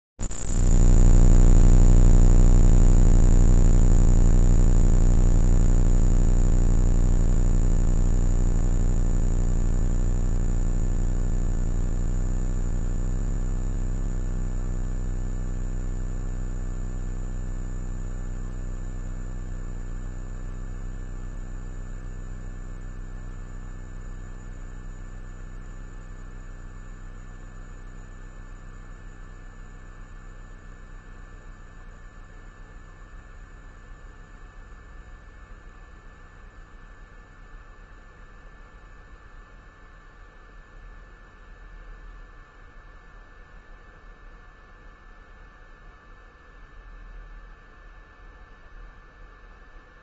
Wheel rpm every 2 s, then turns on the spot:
0, 0, 0, 0, 0, 0, 0, 0, 0, 0, 0, 0, 0, 0, 0, 0, 0, 0, 0, 0, 0, 0, 0, 0, 0.
none